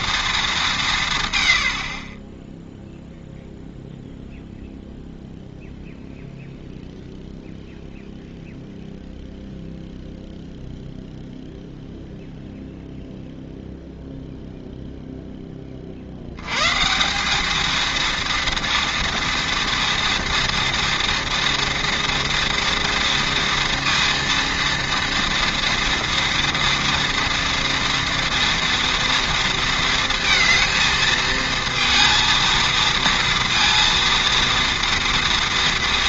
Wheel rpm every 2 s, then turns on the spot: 200, 0, 0, 0, 0, 0, 0, 0, 120, 230, 230, 230, 230, 230, 230, 230, 230, 230.
none